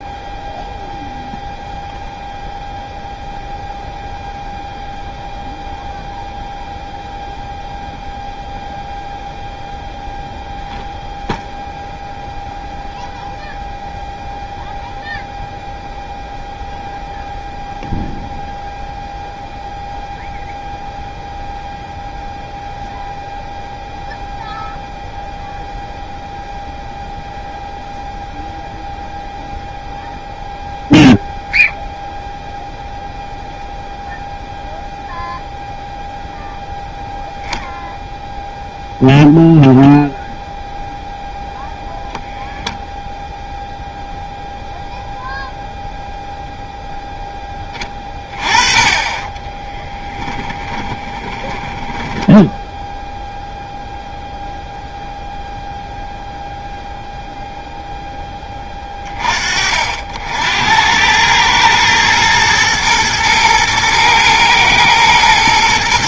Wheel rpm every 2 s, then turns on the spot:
0, 0, 0, 0, 0, 0, 0, 0, 0, 0, 0, 0, 0, 0, 0, 0, 0, 0, 0, 0, 0, 0, 0, 0, 20, 20, 0, 0, 0, 30, 100, 110, 110.
50-52